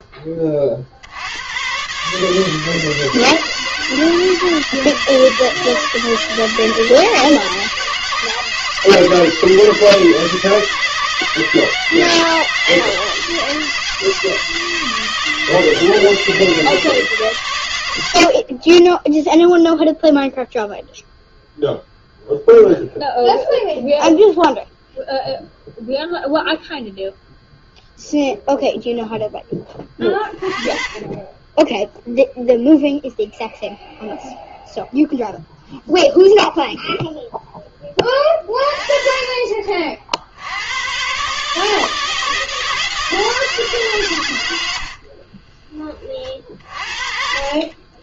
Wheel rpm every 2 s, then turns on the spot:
20, 140, 160, 160, 160, 160, 170, 160, 160, 60, 0, 0, 0, 0, 0, 20, 0, 0, 0, 30, 80, 160, 100, 40.
18-20